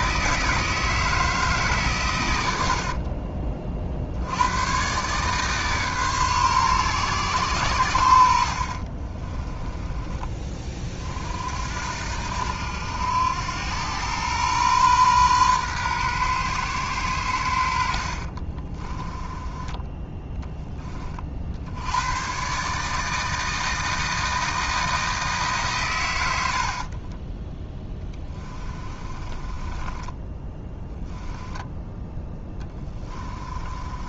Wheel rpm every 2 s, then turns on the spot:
160, 60, 130, 130, 60, 30, 90, 120, 110, 30, 20, 150, 160, 40, 20, 10, 20.
2-4 8-10 18-20 26-34